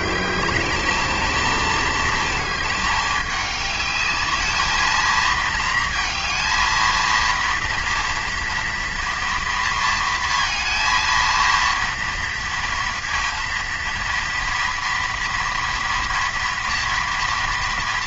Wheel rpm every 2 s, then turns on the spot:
200, 220, 210, 230, 230, 230, 230, 230, 230.
none